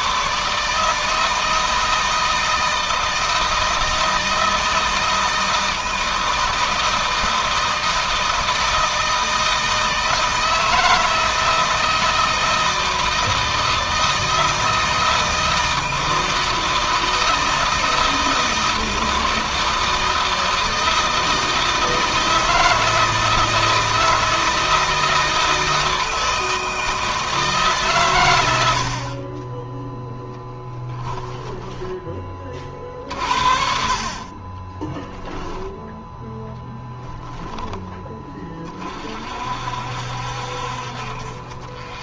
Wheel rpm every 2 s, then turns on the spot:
160, 160, 160, 160, 160, 160, 160, 160, 160, 160, 160, 160, 160, 160, 50, 10, 40, 20, 10, 40, 50.
30-32 34-36